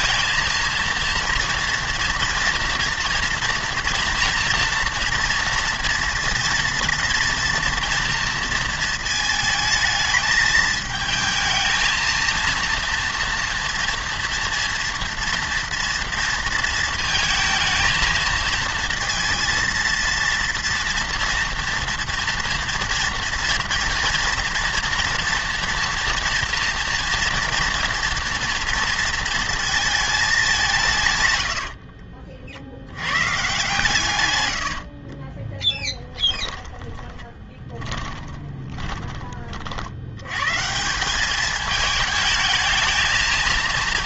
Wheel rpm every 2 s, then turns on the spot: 230, 240, 230, 230, 230, 220, 230, 230, 230, 230, 230, 240, 230, 230, 230, 180, 70, 80, 10, 20, 150, 220.
34-40